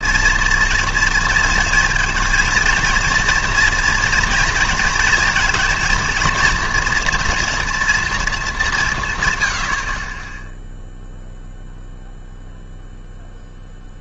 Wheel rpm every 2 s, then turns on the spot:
230, 230, 230, 240, 200, 0, 0.
none